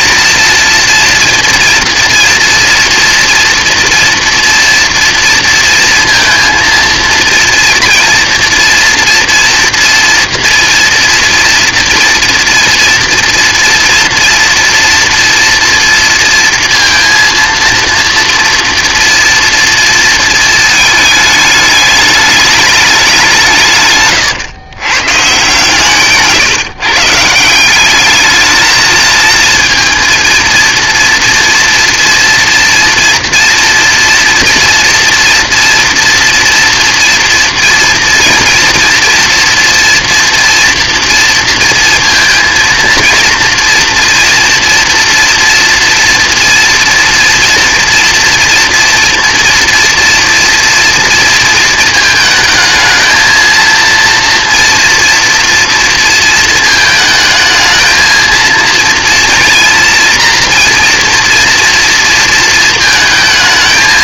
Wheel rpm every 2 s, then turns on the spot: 230, 230, 230, 230, 230, 230, 230, 230, 230, 230, 220, 200, 120, 150, 220, 230, 230, 240, 230, 230, 230, 230, 230, 230, 230, 230, 220, 230, 220, 230, 230, 230.
none